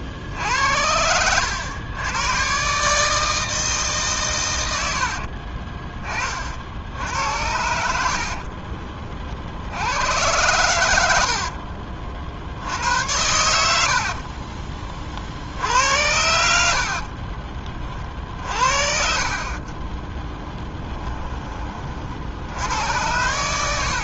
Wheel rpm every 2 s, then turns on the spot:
80, 140, 90, 60, 40, 90, 80, 30, 70, 40, 20, 90.
4-6 8-10 20-22